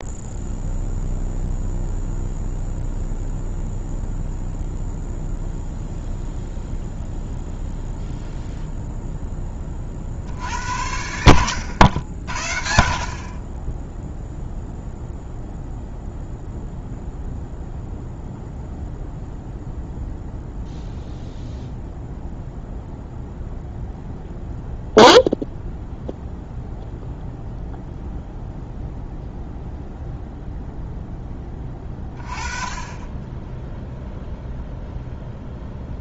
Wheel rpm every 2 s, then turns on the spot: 0, 0, 0, 0, 0, 70, 60, 0, 0, 0, 0, 0, 0, 0, 0, 0, 20, 0.
none